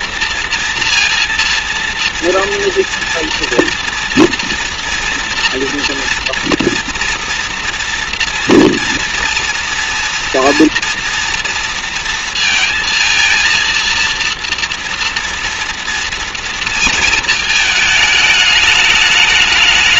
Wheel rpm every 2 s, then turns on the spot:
230, 230, 230, 230, 230, 230, 230, 230, 230, 210.
none